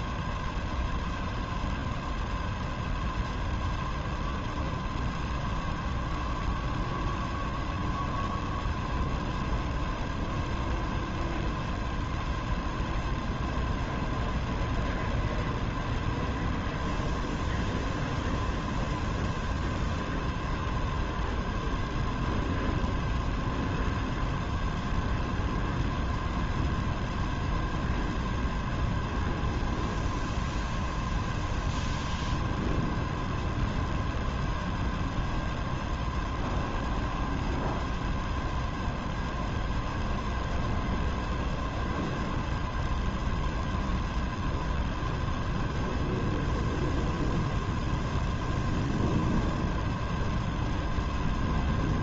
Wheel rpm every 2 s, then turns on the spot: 0, 0, 0, 0, 0, 0, 0, 0, 0, 0, 0, 0, 0, 0, 0, 0, 0, 0, 0, 0, 0, 0, 0, 0, 0, 0.
none